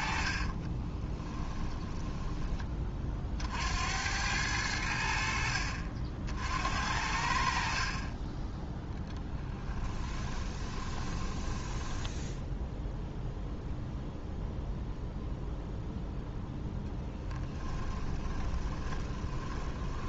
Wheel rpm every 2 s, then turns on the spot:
20, 30, 90, 70, 10, 20, 0, 0, 10, 20.
0-2 8-12 16-20